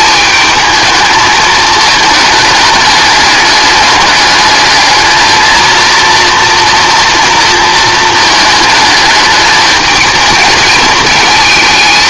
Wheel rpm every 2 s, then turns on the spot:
220, 210, 210, 230, 220, 220.
none